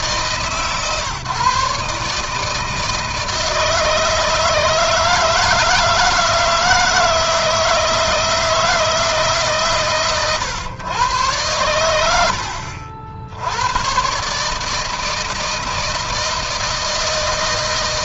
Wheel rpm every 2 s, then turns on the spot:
140, 160, 160, 170, 160, 110, 70, 160, 160.
none